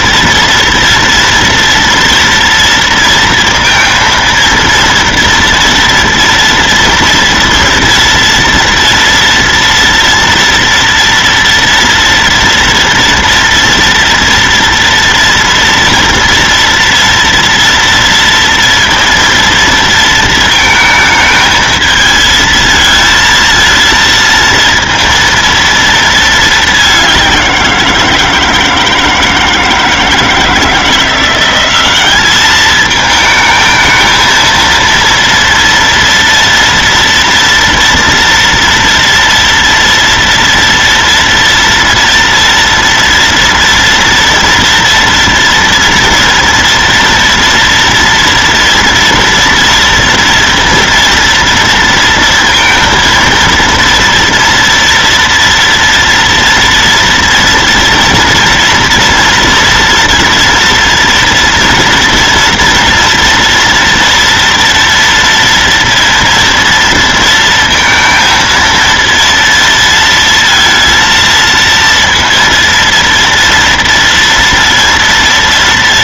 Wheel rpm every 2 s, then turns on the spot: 230, 230, 230, 230, 230, 240, 230, 240, 230, 230, 230, 220, 230, 220, 170, 160, 200, 220, 230, 230, 230, 230, 240, 230, 230, 230, 230, 230, 230, 230, 230, 230, 230, 230, 230, 230, 230, 230.
none